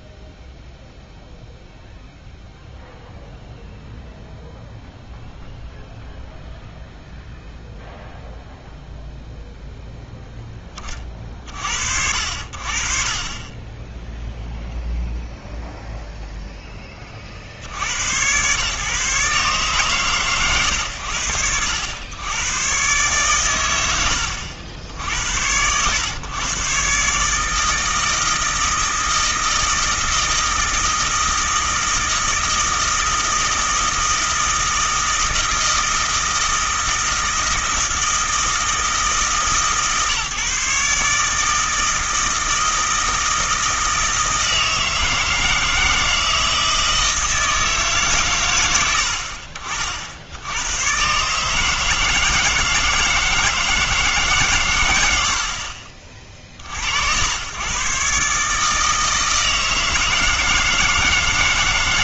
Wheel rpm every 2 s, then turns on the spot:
0, 0, 0, 0, 0, 20, 50, 0, 10, 130, 110, 120, 80, 130, 160, 160, 160, 160, 160, 160, 140, 160, 160, 160, 100, 110, 160, 150, 50, 150, 160.
none